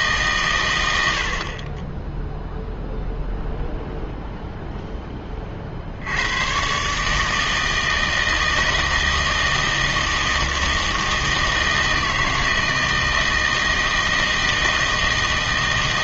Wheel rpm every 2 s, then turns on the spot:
110, 0, 0, 130, 160, 160, 160, 160.
none